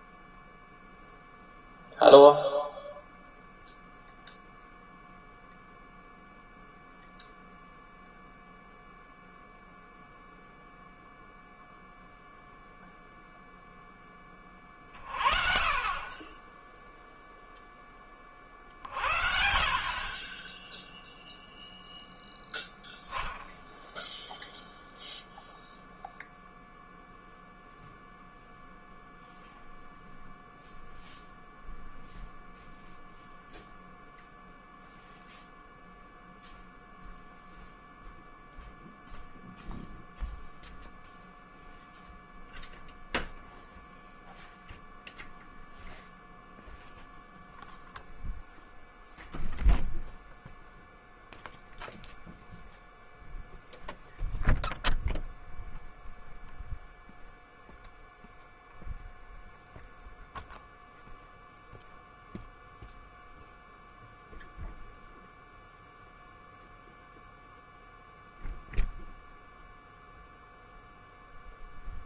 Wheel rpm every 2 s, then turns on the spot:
0, 0, 0, 0, 0, 0, 0, 30, 0, 50, 0, 0, 0, 0, 0, 0, 0, 0, 0, 0, 0, 0, 0, 0, 0, 0, 0, 0, 0, 0, 0, 0, 0, 0, 0, 0.
none